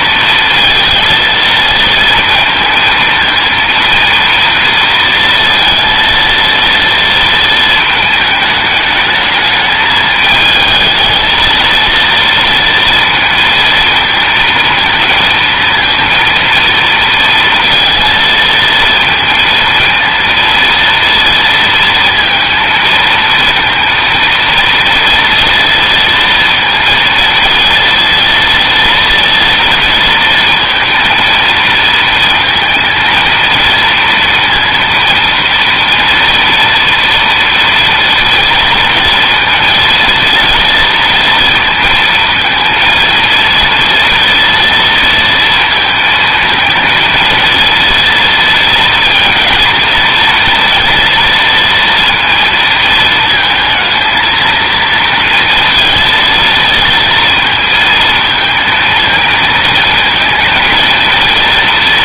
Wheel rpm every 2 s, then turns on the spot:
230, 230, 230, 230, 210, 220, 230, 220, 230, 230, 230, 230, 230, 220, 230, 230, 230, 230, 230, 230, 230, 230, 230, 220, 230, 230, 220, 230, 230, 230, 230.
none